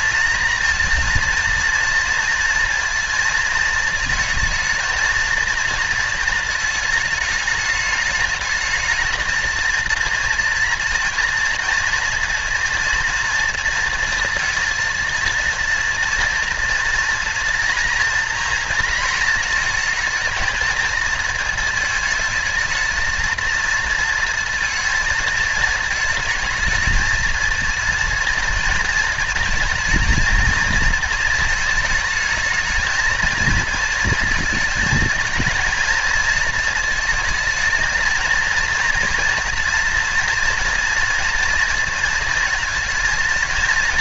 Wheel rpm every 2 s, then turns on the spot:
230, 230, 220, 220, 220, 230, 230, 230, 230, 230, 220, 220, 230, 230, 230, 230, 220, 230, 230, 230, 230, 230.
none